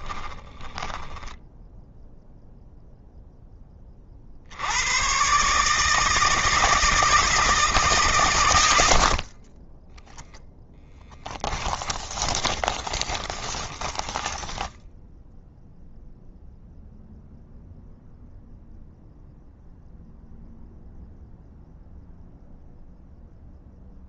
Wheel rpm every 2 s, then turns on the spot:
10, 0, 100, 160, 70, 10, 20, 10, 0, 0, 0, 0.
0-2 12-14